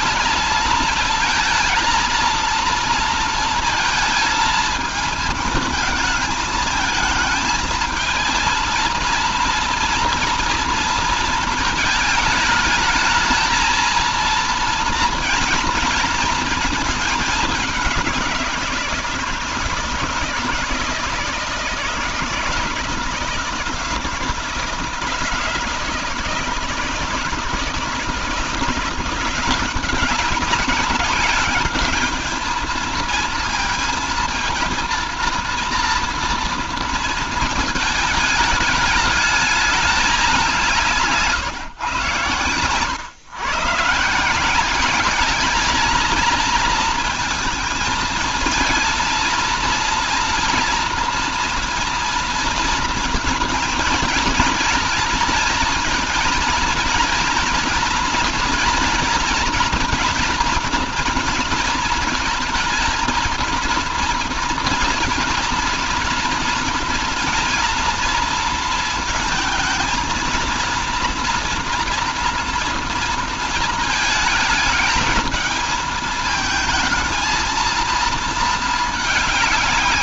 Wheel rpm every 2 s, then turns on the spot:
220, 230, 220, 220, 230, 230, 220, 230, 220, 170, 160, 160, 160, 160, 170, 200, 220, 230, 230, 210, 170, 120, 190, 230, 230, 230, 230, 230, 230, 230, 230, 230, 230, 230, 230, 230, 230, 220, 220, 220.
none